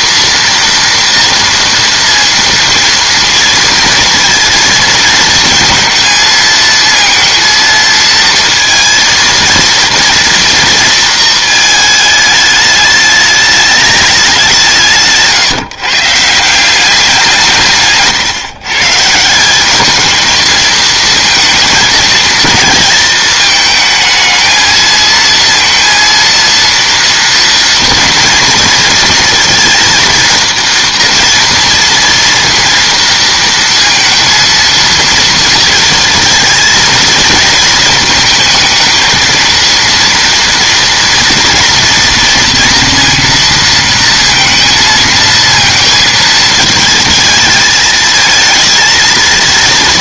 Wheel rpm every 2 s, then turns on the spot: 230, 230, 230, 230, 230, 230, 210, 180, 170, 140, 230, 230, 220, 230, 230, 230, 230, 230, 220, 220, 230, 230, 230, 220, 230.
none